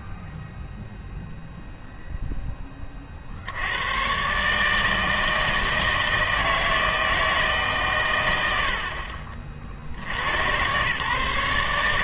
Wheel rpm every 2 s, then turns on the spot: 0, 10, 150, 160, 60, 130.
none